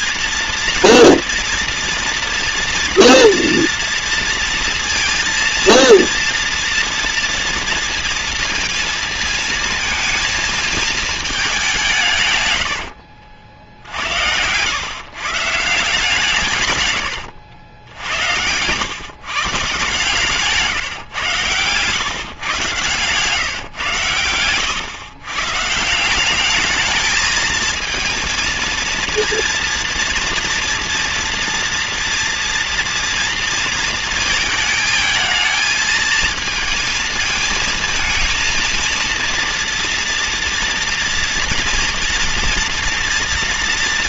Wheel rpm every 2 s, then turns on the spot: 240, 230, 230, 230, 230, 220, 80, 110, 120, 110, 140, 140, 110, 210, 230, 230, 230, 220, 220, 230, 230, 240.
12-14